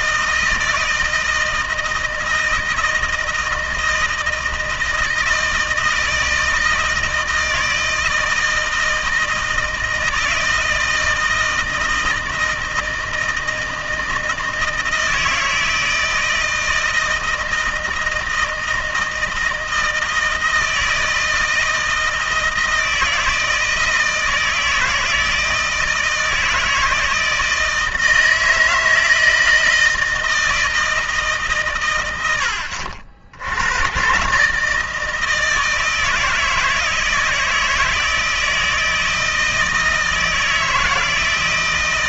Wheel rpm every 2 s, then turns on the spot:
160, 160, 160, 160, 160, 160, 160, 160, 160, 160, 160, 160, 160, 160, 160, 160, 90, 140, 160, 160, 160.
none